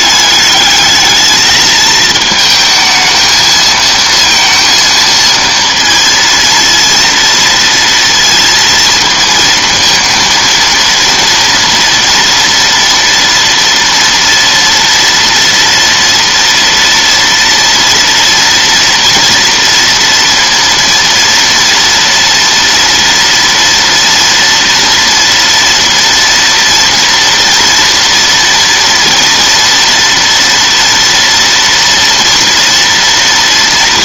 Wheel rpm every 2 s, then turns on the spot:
210, 220, 230, 230, 230, 230, 230, 230, 230, 230, 230, 230, 230, 230, 230, 230, 240.
none